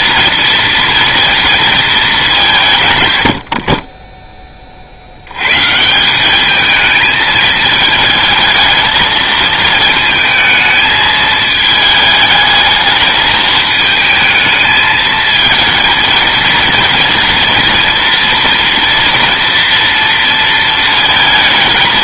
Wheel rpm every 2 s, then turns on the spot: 230, 160, 40, 210, 220, 220, 220, 220, 230, 230, 230.
none